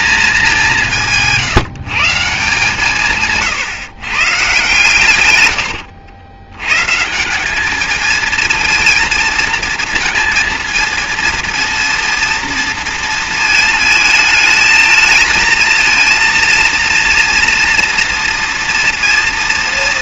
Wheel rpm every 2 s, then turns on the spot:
190, 150, 140, 140, 230, 230, 230, 220, 230, 230.
none